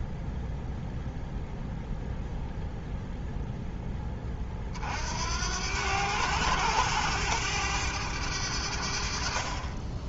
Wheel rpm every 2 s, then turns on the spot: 0, 0, 50, 100, 70.
none